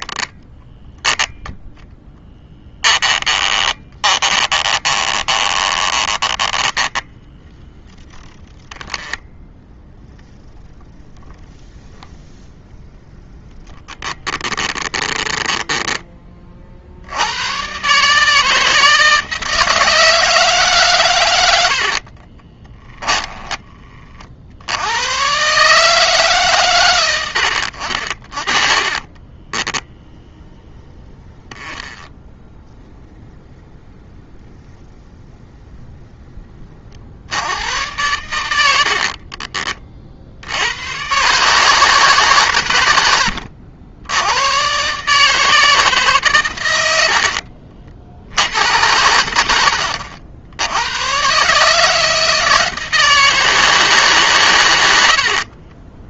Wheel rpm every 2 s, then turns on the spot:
10, 10, 20, 10, 10, 10, 10, 10, 50, 160, 130, 10, 70, 130, 30, 20, 10, 10, 20, 80, 80, 110, 130, 100, 90, 80, 160, 110.
2-8 14-16 22-24 28-34